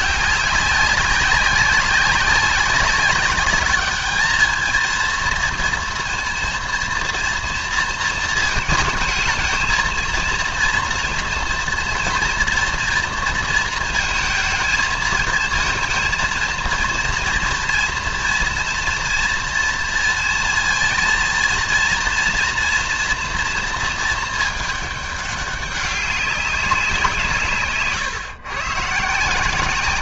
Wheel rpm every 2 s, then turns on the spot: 200, 190, 230, 230, 220, 230, 230, 220, 230, 240, 230, 240, 210, 190, 130.
none